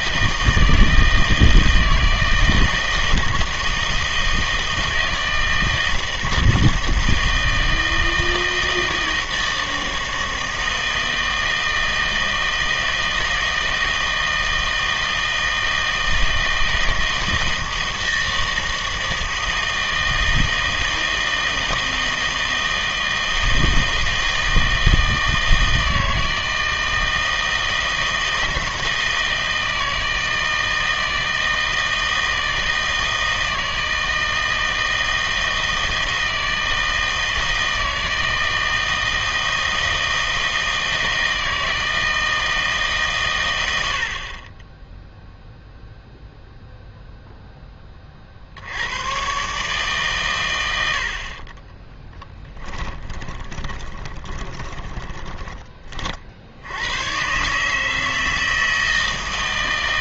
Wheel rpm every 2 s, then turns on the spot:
160, 160, 160, 160, 160, 160, 160, 160, 160, 160, 160, 160, 160, 160, 160, 160, 160, 160, 160, 160, 160, 150, 20, 0, 80, 90, 20, 20, 80, 160.
52-56